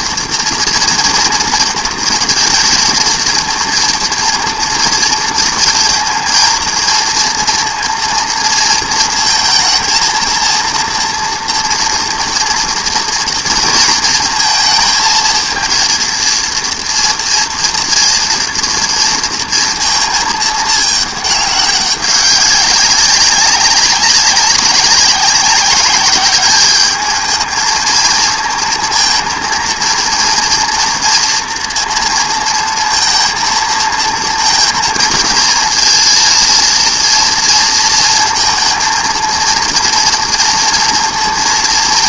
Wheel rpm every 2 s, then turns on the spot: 230, 230, 230, 230, 230, 230, 230, 220, 230, 230, 220, 190, 190, 200, 230, 230, 230, 230, 230, 230, 240.
none